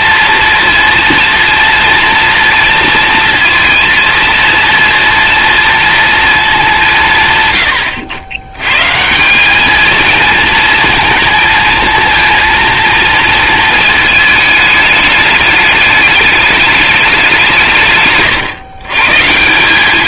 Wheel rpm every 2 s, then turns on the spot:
230, 230, 230, 180, 130, 230, 230, 210, 210, 140.
none